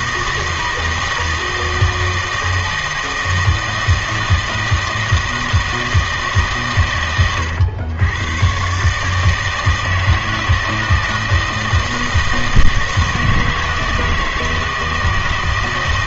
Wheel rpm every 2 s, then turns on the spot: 160, 160, 160, 140, 130, 160, 160, 160.
none